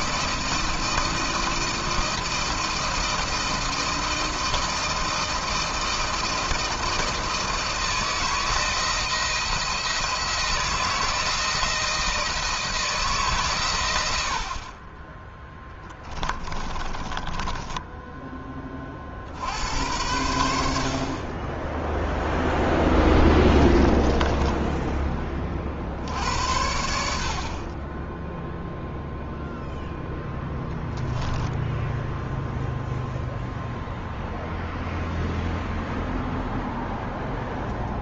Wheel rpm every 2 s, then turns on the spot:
160, 160, 160, 160, 160, 160, 160, 70, 20, 20, 80, 0, 20, 80, 10, 10, 0, 0, 0.
16-18 24-26 30-32